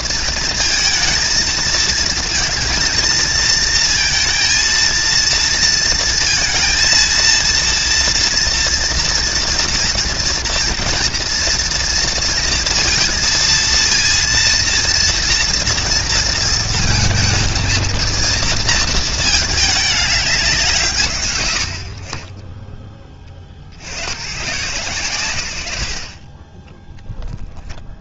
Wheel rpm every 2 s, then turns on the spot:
230, 230, 230, 230, 230, 230, 230, 230, 220, 230, 130, 30, 100, 20.
none